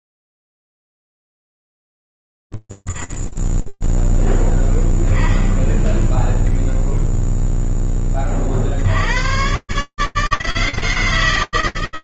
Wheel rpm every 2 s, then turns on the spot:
0, 0, 0, 0, 50, 160.
none